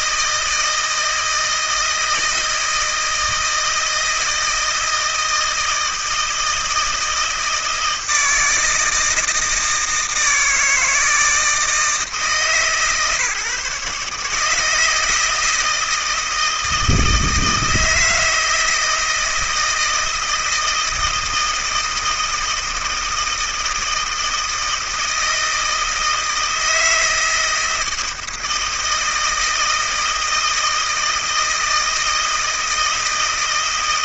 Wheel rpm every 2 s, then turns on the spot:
160, 160, 160, 160, 160, 160, 150, 160, 160, 160, 160, 160, 160, 160, 160, 160, 160.
none